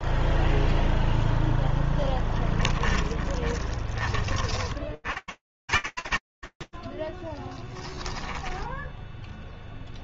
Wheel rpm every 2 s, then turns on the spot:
0, 10, 60, 60, 10.
2-4